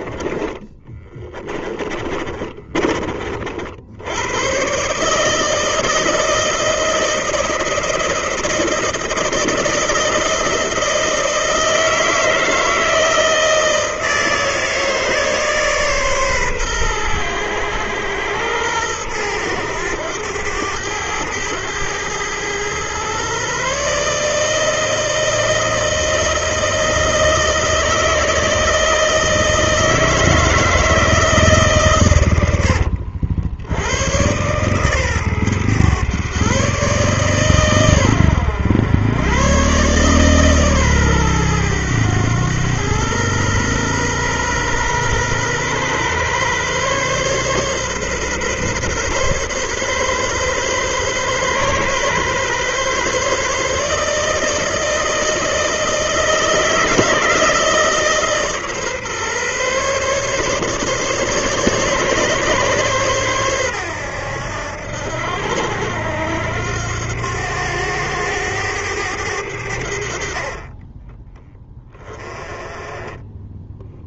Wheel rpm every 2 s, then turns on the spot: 20, 40, 140, 160, 160, 160, 160, 150, 110, 110, 100, 120, 160, 160, 160, 160, 70, 130, 140, 100, 130, 110, 120, 140, 130, 130, 140, 160, 160, 140, 140, 130, 80, 90, 100, 20, 20.
0-2